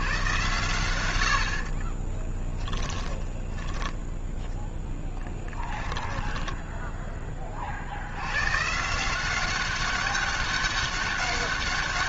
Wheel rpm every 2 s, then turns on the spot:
110, 30, 10, 10, 100, 200.
2-8